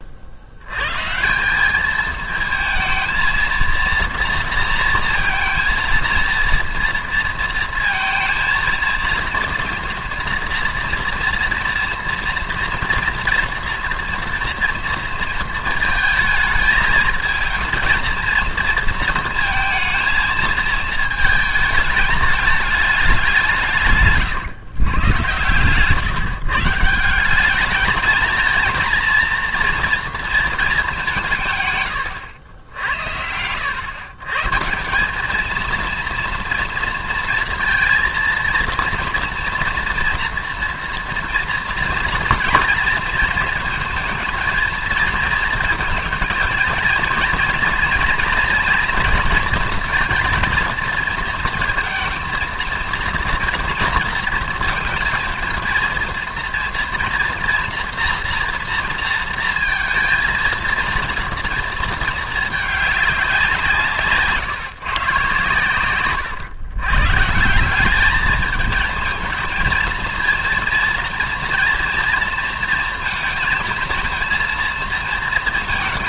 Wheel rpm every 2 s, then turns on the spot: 70, 230, 230, 230, 230, 240, 230, 230, 220, 230, 220, 210, 130, 140, 220, 220, 90, 150, 240, 230, 240, 230, 230, 230, 230, 230, 230, 230, 230, 230, 230, 210, 150, 110, 210, 230, 230, 230.
none